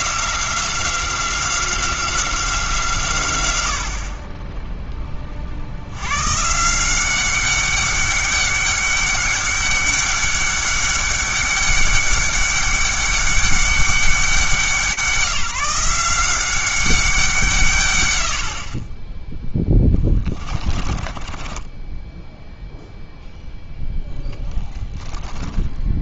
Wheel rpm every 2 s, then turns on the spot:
180, 160, 10, 160, 200, 200, 200, 170, 190, 50, 30, 0, 10.
20-22